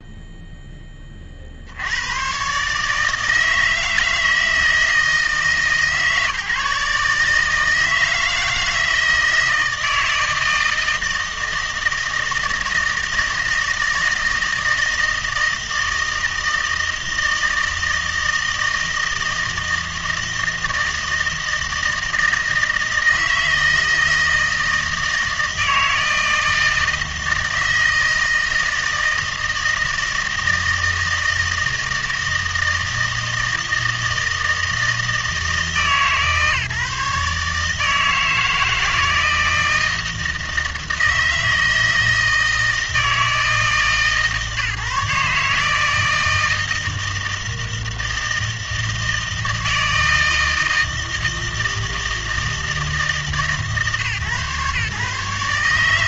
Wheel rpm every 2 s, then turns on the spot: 10, 140, 160, 150, 160, 160, 160, 160, 160, 160, 160, 160, 160, 160, 160, 160, 160, 160, 150, 160, 160, 160, 150, 160, 160, 160, 160, 130.
none